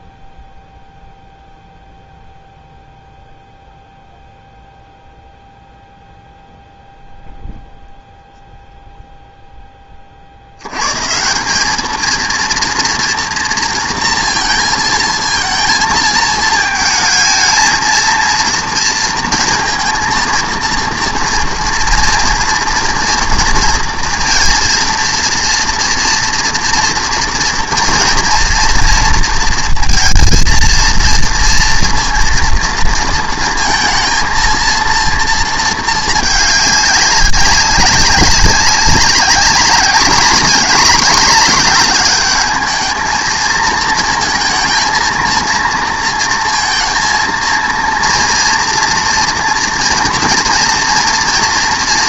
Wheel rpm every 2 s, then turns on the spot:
0, 0, 0, 0, 0, 90, 230, 230, 220, 230, 230, 230, 230, 230, 230, 230, 230, 230, 210, 190, 210, 220, 220, 230, 230, 240.
none